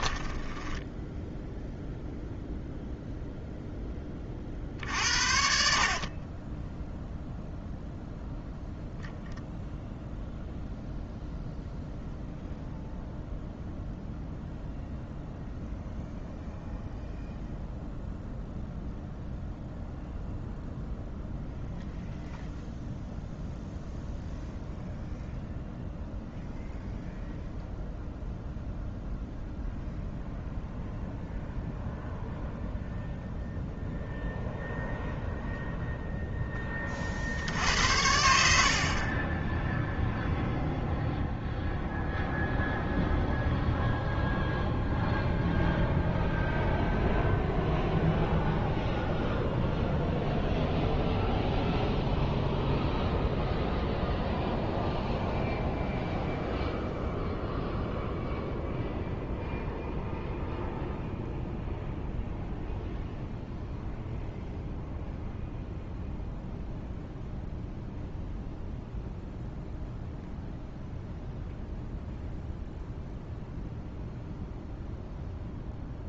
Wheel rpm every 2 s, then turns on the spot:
10, 0, 60, 10, 0, 0, 0, 0, 0, 0, 0, 0, 0, 0, 0, 0, 0, 0, 40, 40, 0, 0, 0, 0, 0, 0, 0, 0, 0, 0, 0, 0, 0, 0, 0, 0, 0, 0.
0-2 6-8